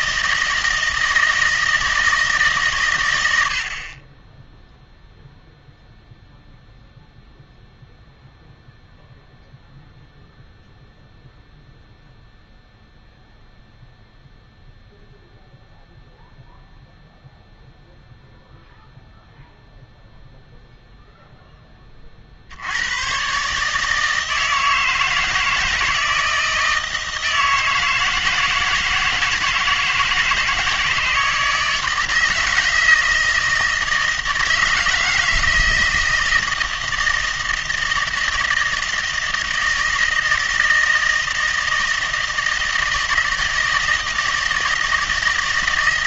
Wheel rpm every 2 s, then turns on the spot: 160, 130, 0, 0, 0, 0, 0, 0, 0, 0, 0, 90, 160, 160, 160, 160, 160, 160, 160, 160, 160, 160, 160.
none